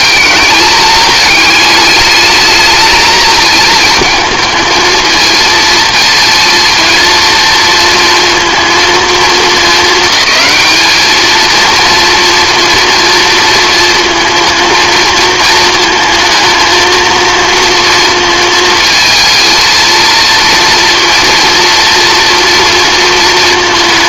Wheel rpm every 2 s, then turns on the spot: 210, 220, 230, 230, 220, 220, 230, 220, 230, 230, 240, 230.
none